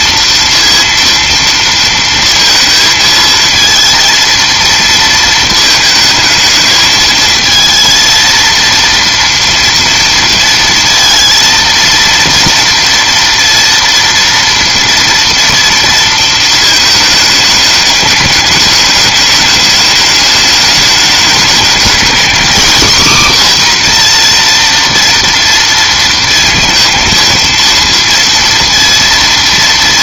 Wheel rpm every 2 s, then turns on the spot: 230, 230, 230, 220, 230, 230, 230, 230, 220, 210, 210, 240, 230, 230, 230.
none